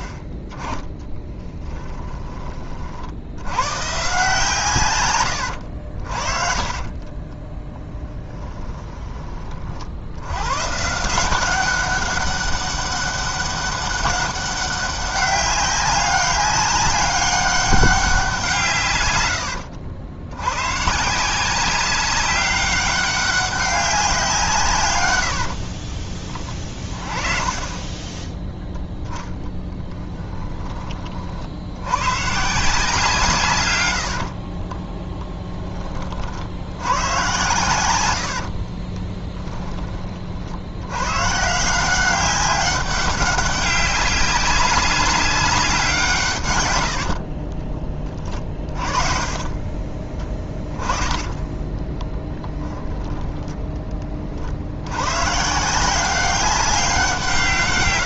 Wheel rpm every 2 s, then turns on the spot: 20, 40, 140, 40, 20, 140, 200, 200, 200, 150, 130, 200, 130, 30, 0, 30, 160, 30, 90, 30, 90, 190, 190, 90, 30, 20, 10, 70, 190.
6-10 26-28 34-36 38-40 46-54